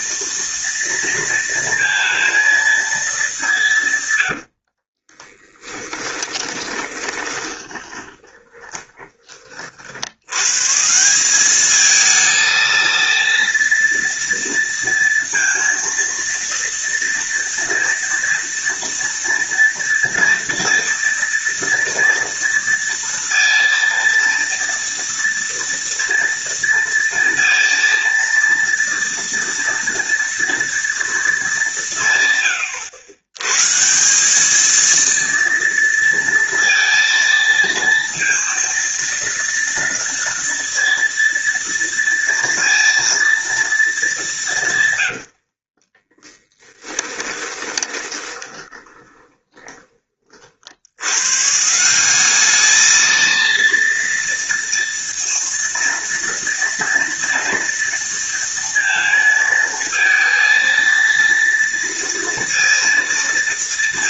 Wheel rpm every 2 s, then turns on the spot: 230, 230, 80, 20, 20, 130, 230, 230, 230, 230, 230, 230, 230, 230, 230, 230, 120, 210, 230, 230, 230, 230, 180, 20, 20, 70, 210, 230, 230, 230, 230, 230.
4-10 46-50